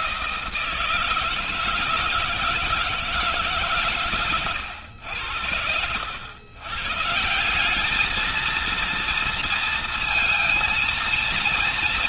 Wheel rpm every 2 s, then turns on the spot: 170, 160, 110, 120, 220, 230.
none